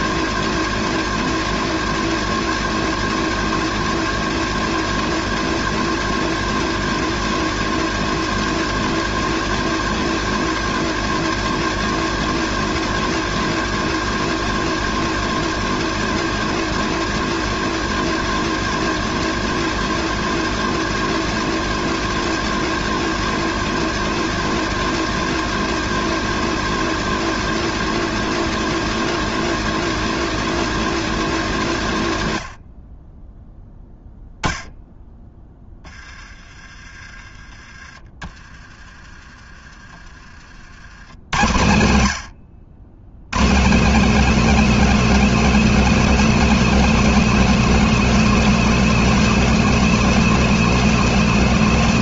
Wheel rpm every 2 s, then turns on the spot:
230, 240, 230, 230, 230, 230, 230, 230, 230, 230, 230, 240, 230, 240, 240, 230, 50, 0, 30, 30, 80, 100, 250, 240, 240, 240.
none